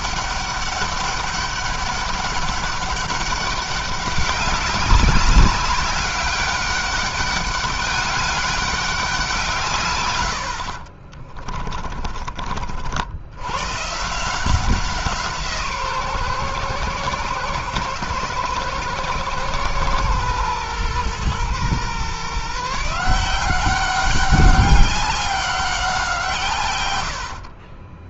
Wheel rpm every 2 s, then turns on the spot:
200, 200, 190, 200, 180, 40, 70, 170, 130, 120, 120, 160, 190, 100.
10-12